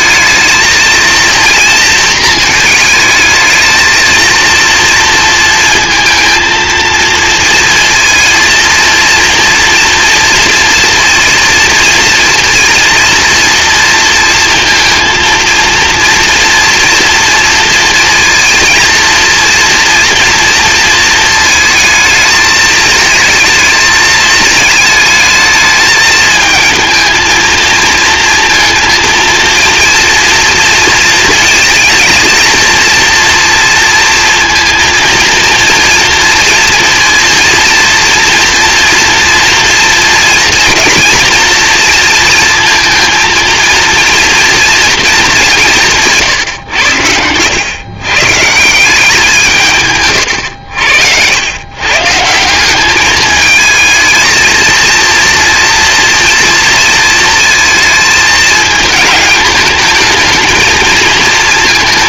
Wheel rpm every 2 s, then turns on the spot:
230, 220, 230, 230, 230, 230, 230, 230, 230, 230, 230, 220, 220, 220, 230, 230, 230, 230, 230, 230, 230, 230, 220, 100, 180, 80, 210, 230, 230, 220, 220.
none